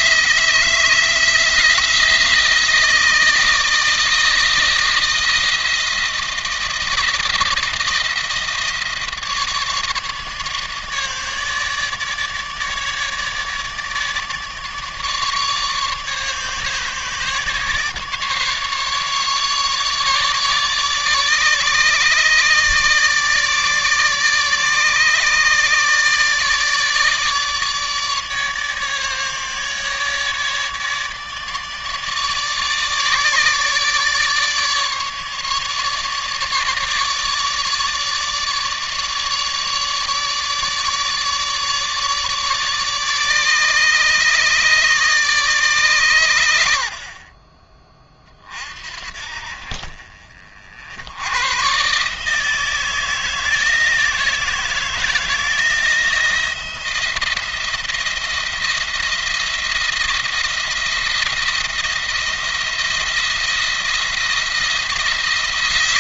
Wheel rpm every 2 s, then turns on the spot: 160, 160, 160, 160, 160, 150, 150, 150, 150, 150, 150, 150, 150, 150, 150, 150, 150, 150, 150, 150, 150, 150, 150, 80, 50, 70, 160, 160, 170, 170, 170, 170, 170.
none